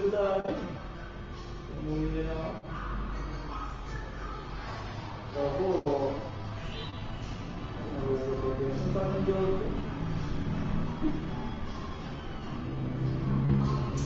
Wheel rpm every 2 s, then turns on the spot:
0, 0, 0, 0, 0, 0, 0.
none